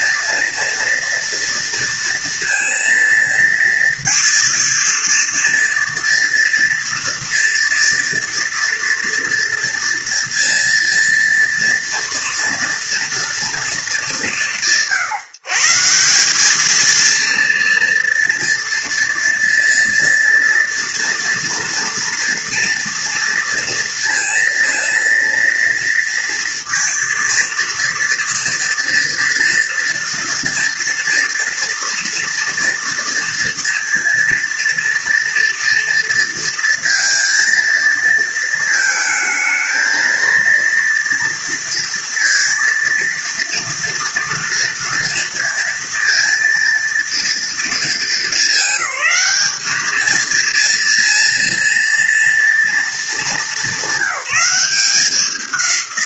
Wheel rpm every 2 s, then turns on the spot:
230, 230, 230, 230, 240, 230, 230, 170, 210, 230, 230, 230, 230, 230, 230, 230, 230, 230, 230, 230, 230, 230, 230, 230, 210, 230, 230, 190.
none